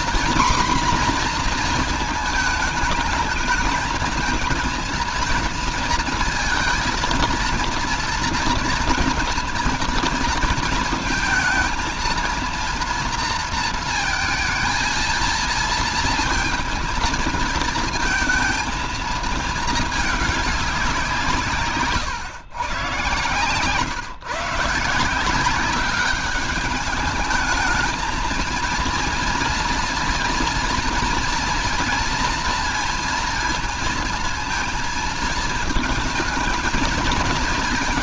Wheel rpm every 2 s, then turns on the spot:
250, 220, 230, 230, 230, 230, 230, 230, 220, 220, 200, 140, 150, 200, 230, 230, 230, 230, 220.
none